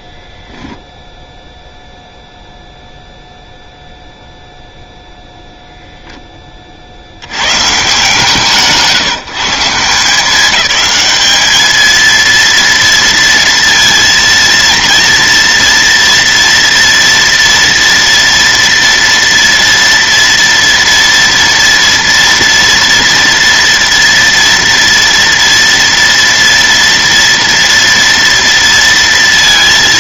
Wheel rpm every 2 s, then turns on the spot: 0, 0, 0, 50, 160, 210, 230, 230, 230, 230, 230, 230, 230, 230, 230.
none